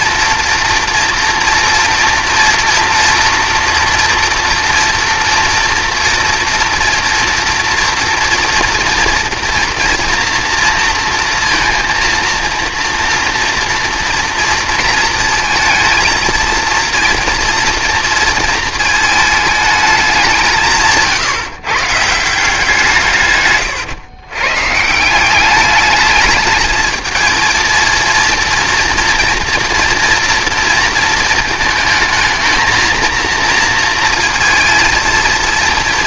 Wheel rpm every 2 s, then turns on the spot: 230, 240, 230, 240, 230, 230, 230, 230, 230, 220, 160, 170, 140, 220, 230, 230, 220, 230.
none